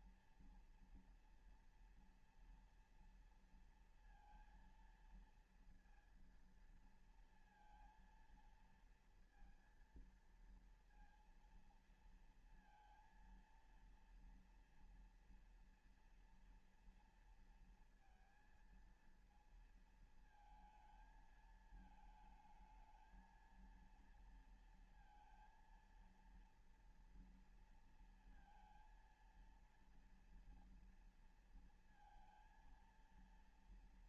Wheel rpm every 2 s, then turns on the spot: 230, 230, 230, 230, 230, 230, 230, 230, 230, 230, 220, 220, 230, 230, 220, 230, 230.
none